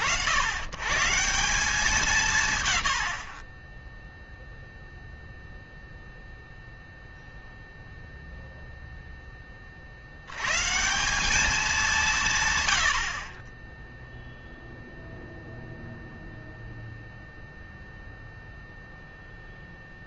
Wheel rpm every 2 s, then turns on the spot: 90, 110, 0, 0, 0, 140, 110, 0, 0, 0.
none